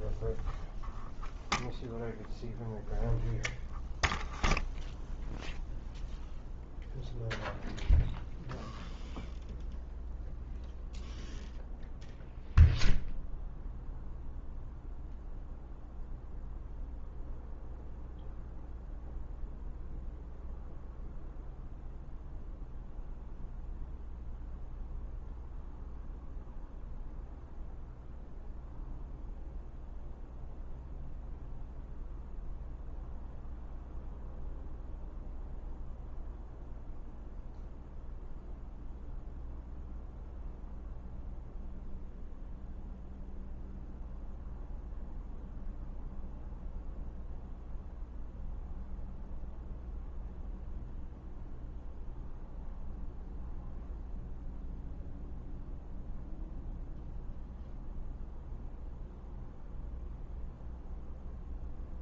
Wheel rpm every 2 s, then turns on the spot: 0, 0, 0, 0, 0, 0, 0, 0, 0, 0, 0, 0, 0, 0, 0, 0, 0, 0, 0, 0, 0, 0, 0, 0, 0, 0, 0, 0, 0, 0, 0.
none